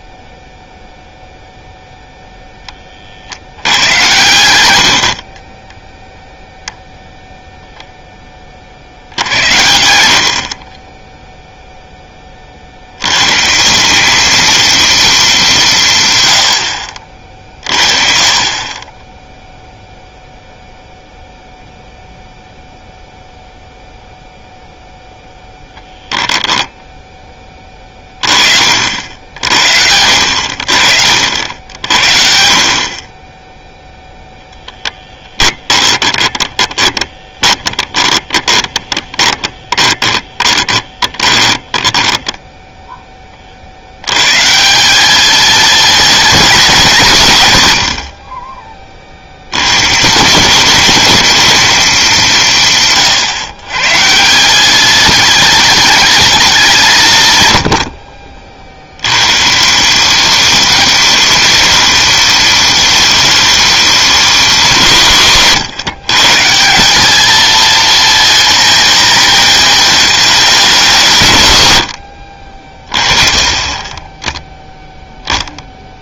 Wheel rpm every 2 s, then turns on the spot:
0, 20, 50, 0, 40, 30, 70, 230, 60, 20, 0, 0, 0, 0, 50, 60, 40, 10, 20, 20, 30, 10, 180, 190, 30, 200, 150, 190, 170, 70, 210, 210, 160, 190, 230, 170, 40, 0.
4-6 10-12 36-42